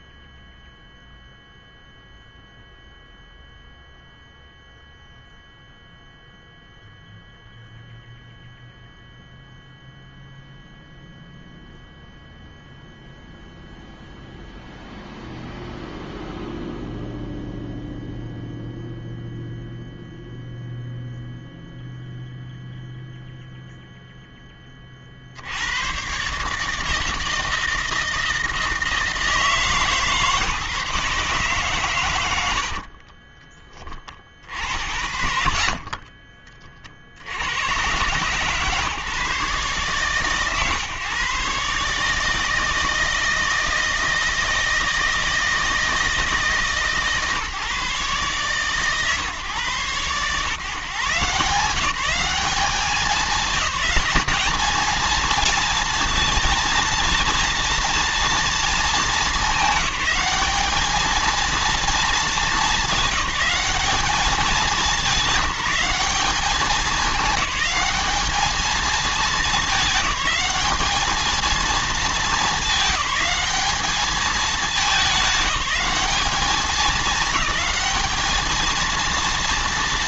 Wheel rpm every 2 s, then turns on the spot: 0, 0, 0, 0, 0, 0, 0, 0, 0, 0, 0, 0, 30, 150, 160, 150, 50, 60, 40, 130, 130, 160, 160, 140, 140, 140, 200, 220, 230, 230, 210, 210, 210, 210, 220, 210, 210, 200, 210, 220.
32-36